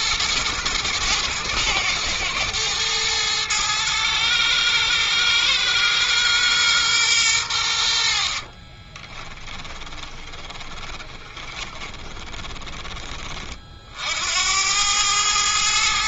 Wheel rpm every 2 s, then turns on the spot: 110, 110, 110, 120, 20, 20, 20, 100.
8-12